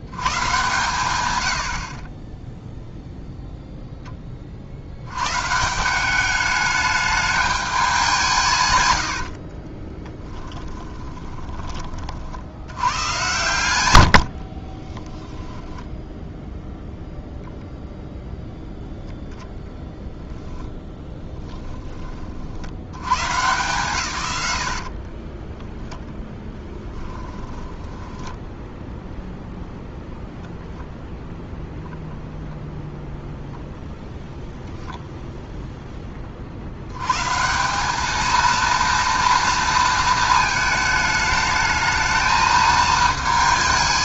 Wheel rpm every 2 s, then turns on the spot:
120, 0, 60, 210, 130, 20, 90, 30, 0, 0, 10, 90, 80, 10, 0, 0, 0, 0, 90, 230, 220, 220.
8-12 14-16 24-28